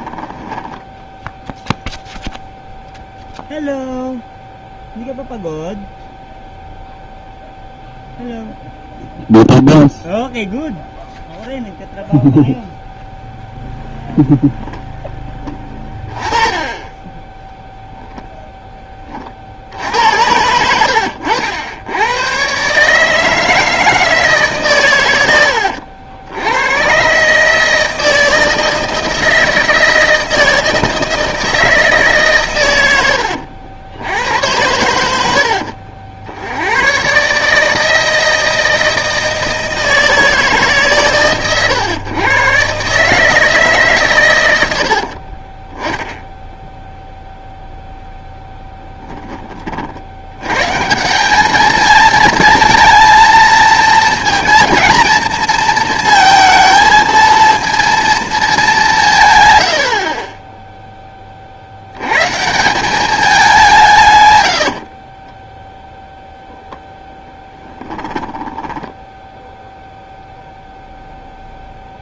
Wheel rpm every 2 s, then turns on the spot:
20, 0, 0, 0, 0, 0, 0, 10, 20, 10, 100, 130, 140, 90, 160, 160, 100, 100, 80, 160, 150, 130, 100, 10, 10, 130, 220, 220, 220, 200, 10, 200, 80, 0, 10, 0.
0-2 44-50 60-62 64-66 68-70